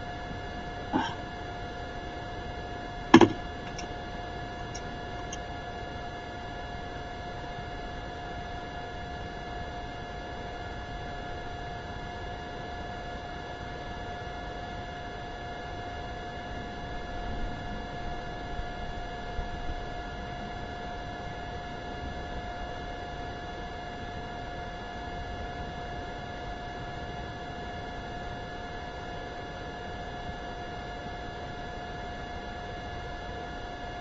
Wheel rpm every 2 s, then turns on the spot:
0, 0, 0, 0, 0, 0, 0, 0, 0, 0, 0, 0, 0, 0, 0, 0, 0.
none